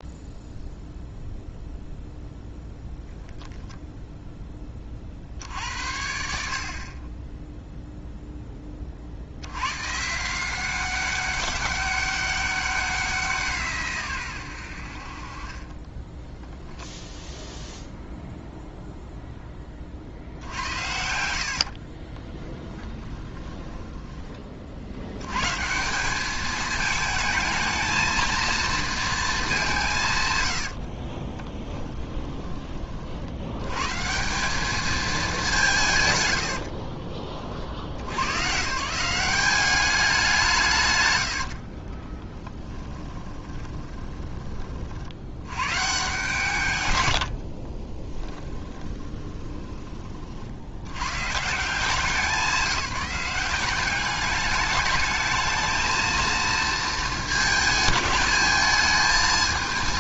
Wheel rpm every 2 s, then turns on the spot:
0, 0, 20, 50, 20, 180, 190, 90, 10, 0, 80, 10, 50, 220, 230, 80, 20, 210, 80, 140, 120, 10, 20, 120, 10, 70, 190, 210, 230, 210.
22-24 30-32 36-38 42-44 48-50